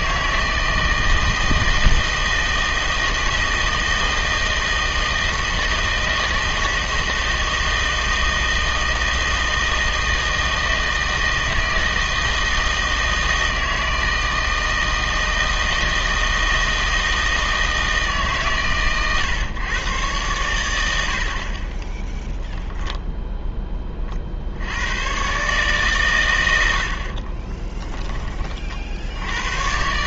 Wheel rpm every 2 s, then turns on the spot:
160, 160, 160, 160, 160, 160, 160, 160, 160, 130, 110, 0, 80, 80, 50.
none